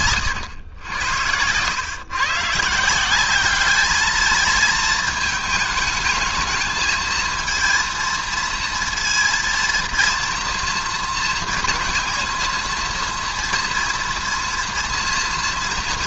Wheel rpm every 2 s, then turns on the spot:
100, 140, 220, 220, 230, 230, 230, 230.
none